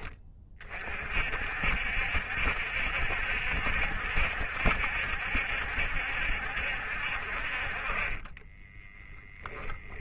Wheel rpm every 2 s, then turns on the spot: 40, 70, 70, 60, 10.
8-10